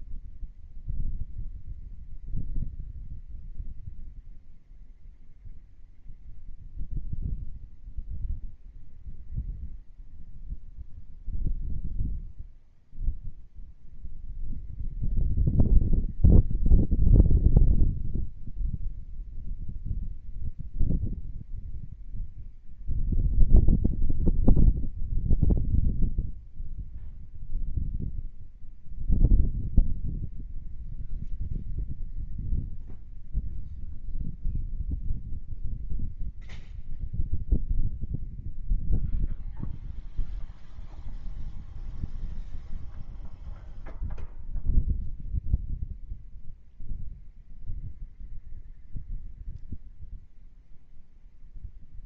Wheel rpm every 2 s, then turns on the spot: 0, 0, 0, 0, 0, 0, 0, 0, 0, 0, 0, 0, 0, 0, 0, 0, 0, 0, 0, 0, 0, 0, 0, 0, 0, 0.
none